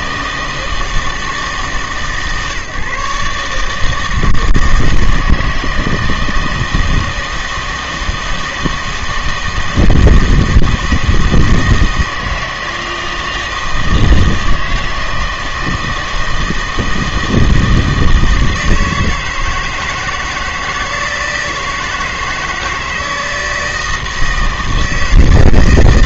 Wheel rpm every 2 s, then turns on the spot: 160, 140, 160, 160, 160, 160, 160, 160, 160, 160, 160, 160, 160.
none